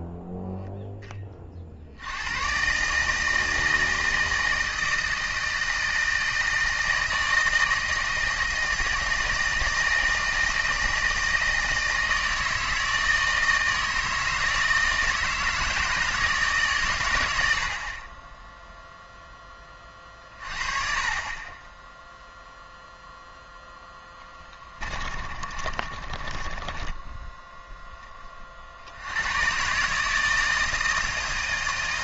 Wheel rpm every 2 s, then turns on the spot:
0, 120, 160, 160, 160, 160, 160, 160, 150, 0, 30, 0, 20, 20, 30, 160.
24-28